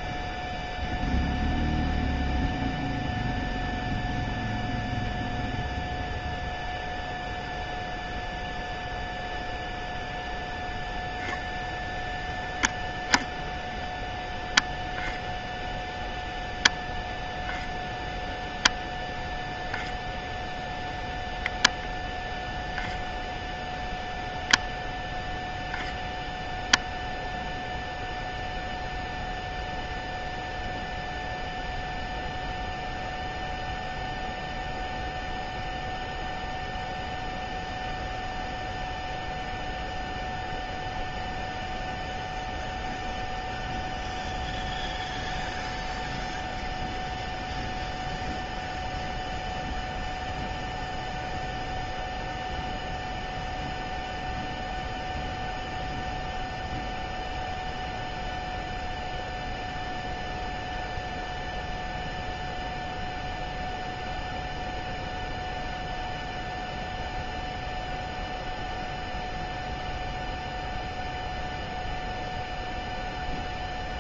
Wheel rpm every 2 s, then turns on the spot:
0, 0, 0, 0, 0, 0, 0, 0, 0, 0, 0, 0, 0, 0, 0, 0, 0, 0, 0, 0, 0, 0, 0, 0, 0, 0, 0, 0, 0, 0, 0, 0, 0, 0, 0, 0, 0.
none